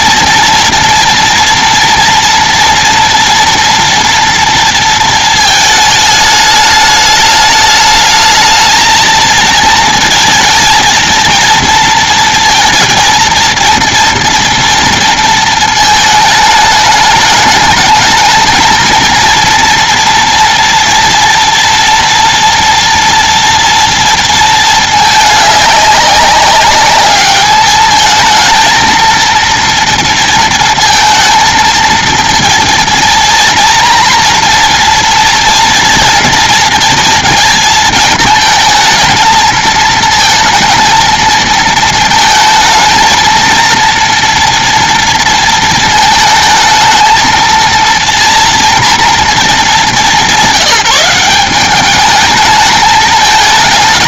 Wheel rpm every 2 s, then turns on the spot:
240, 240, 230, 210, 220, 230, 230, 230, 210, 230, 230, 230, 210, 200, 230, 230, 230, 230, 230, 220, 230, 220, 230, 220, 230, 180, 220.
none